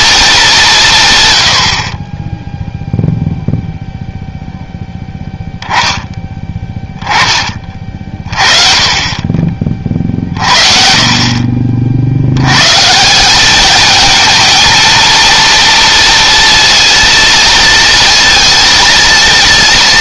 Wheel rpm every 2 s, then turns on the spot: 160, 0, 10, 20, 30, 40, 140, 230, 230, 230.
none